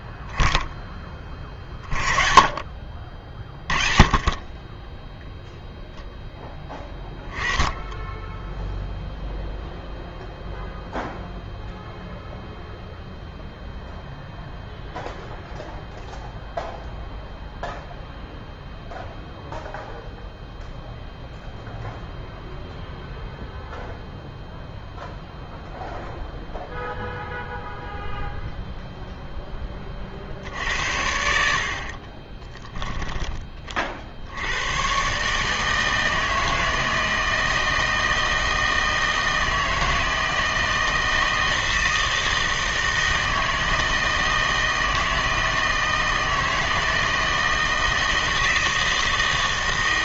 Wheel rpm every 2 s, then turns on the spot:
10, 40, 20, 10, 0, 0, 0, 0, 0, 0, 0, 0, 0, 0, 0, 60, 10, 100, 160, 160, 160, 160, 160, 160, 160.
32-34